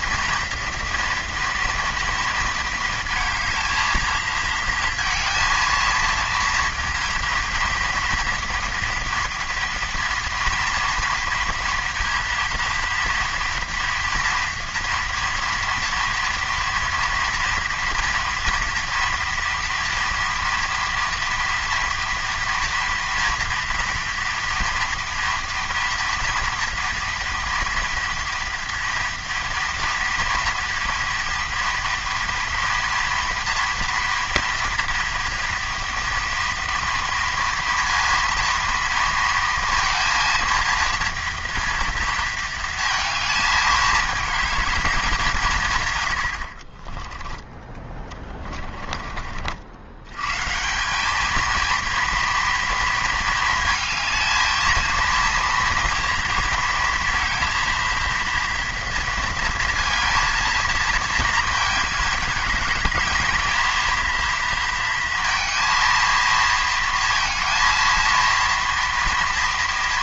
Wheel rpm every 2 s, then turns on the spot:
230, 220, 230, 230, 230, 230, 230, 230, 230, 240, 230, 230, 230, 230, 230, 230, 230, 230, 230, 230, 230, 220, 190, 20, 50, 220, 230, 230, 230, 230, 220, 220, 230, 230, 240.
46-48